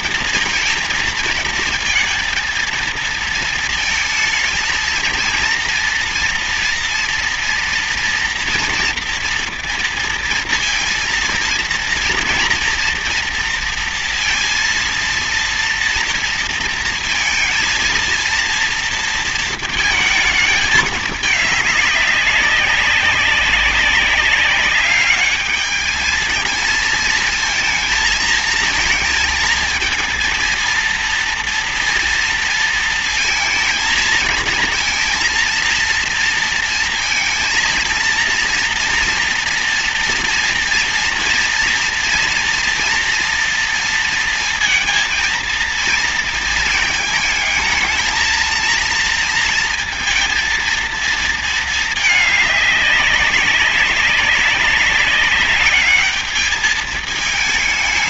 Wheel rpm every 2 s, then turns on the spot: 220, 220, 220, 230, 230, 230, 230, 230, 230, 230, 210, 200, 200, 220, 220, 230, 230, 230, 230, 230, 230, 230, 230, 220, 230, 220, 200, 200, 220.
none